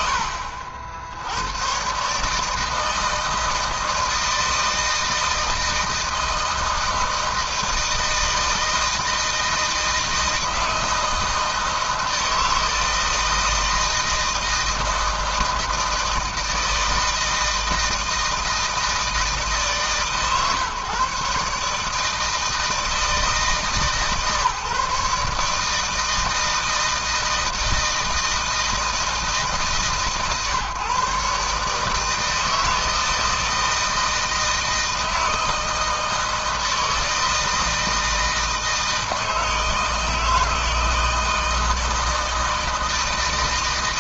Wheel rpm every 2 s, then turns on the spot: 70, 160, 160, 160, 160, 160, 160, 160, 160, 160, 140, 160, 140, 160, 160, 140, 160, 160, 160, 160, 160, 160.
none